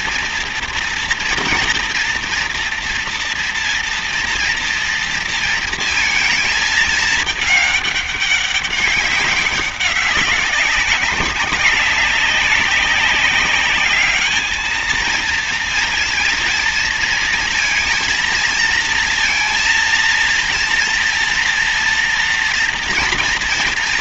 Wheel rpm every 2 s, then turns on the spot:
230, 230, 230, 220, 200, 190, 190, 220, 230, 230, 230, 230.
none